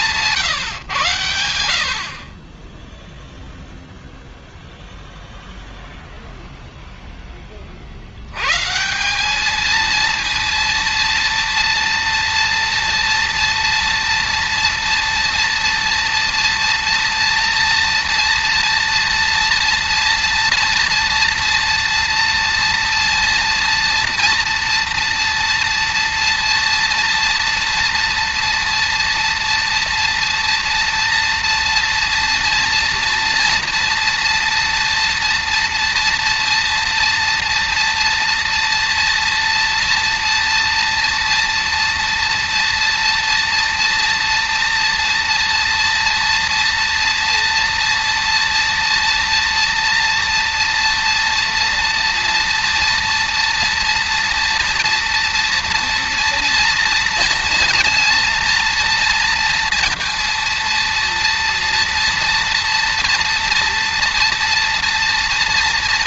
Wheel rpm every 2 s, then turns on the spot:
150, 10, 0, 10, 190, 230, 230, 240, 240, 230, 230, 230, 230, 230, 230, 230, 240, 230, 240, 230, 230, 230, 230, 230, 230, 230, 230, 230, 230, 230, 230, 240, 230.
none